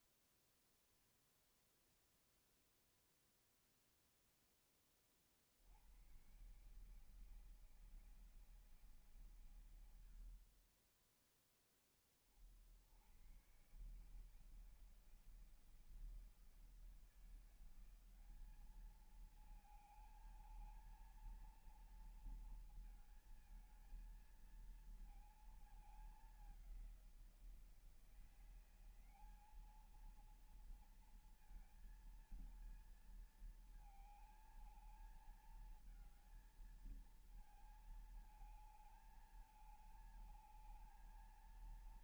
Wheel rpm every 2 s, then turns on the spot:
0, 0, 10, 120, 160, 50, 40, 150, 160, 200, 220, 220, 230, 200, 170, 230, 230, 220, 220, 220, 220.
none